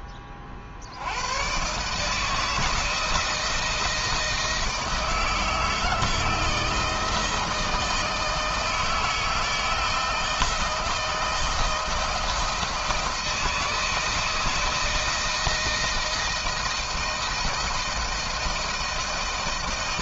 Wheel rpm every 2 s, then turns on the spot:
30, 160, 160, 160, 160, 160, 160, 160, 170, 170.
none